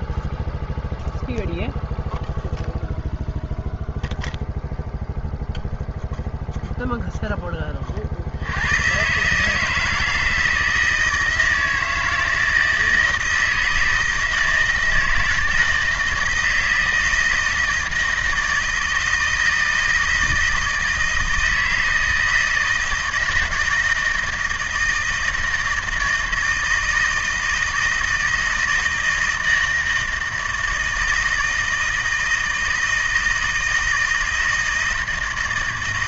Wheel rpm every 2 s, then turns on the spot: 0, 0, 0, 0, 120, 160, 160, 160, 160, 160, 160, 160, 160, 160, 160, 160, 160, 160.
none